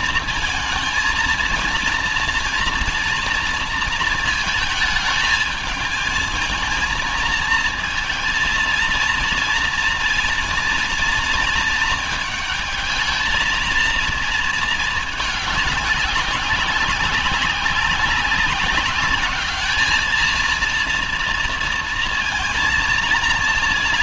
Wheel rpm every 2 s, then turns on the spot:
220, 230, 220, 220, 230, 230, 220, 210, 190, 200, 230, 230.
none